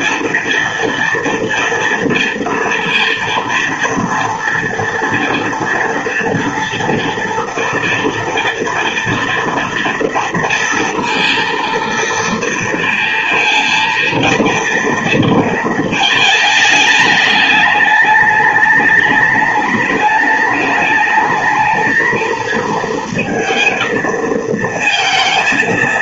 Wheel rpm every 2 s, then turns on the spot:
230, 230, 230, 230, 230, 230, 230, 230, 220, 210, 210, 220, 220.
none